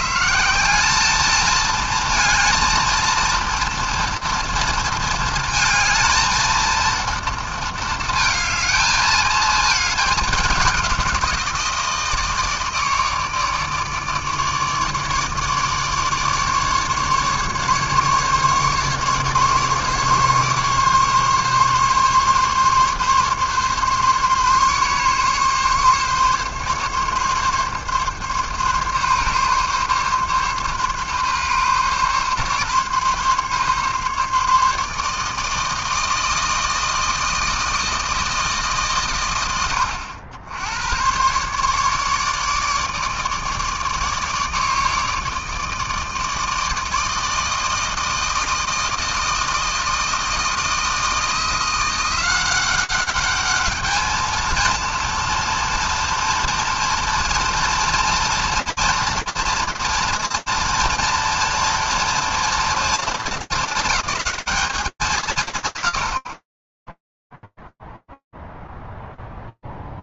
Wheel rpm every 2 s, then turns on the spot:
170, 230, 230, 230, 220, 200, 160, 150, 150, 150, 150, 140, 140, 140, 140, 140, 140, 150, 160, 150, 90, 150, 160, 160, 160, 160, 190, 230, 230, 230, 230, 220, 190, 10, 0.
none